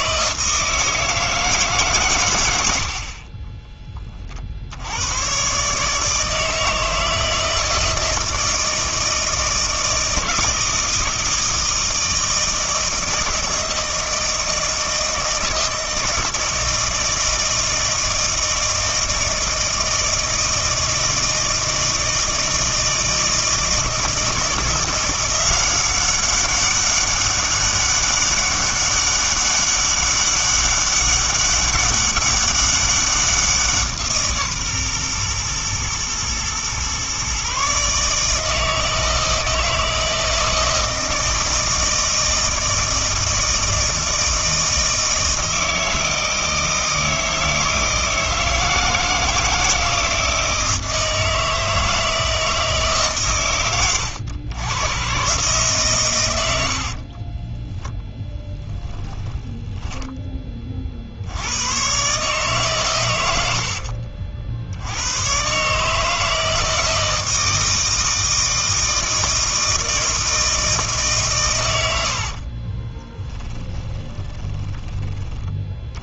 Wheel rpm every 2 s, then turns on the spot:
160, 70, 90, 160, 160, 160, 160, 160, 160, 160, 160, 160, 170, 200, 200, 200, 190, 130, 130, 160, 160, 160, 160, 160, 160, 160, 150, 110, 60, 10, 50, 120, 90, 160, 160, 150, 20, 20.
2-4 56-60 72-74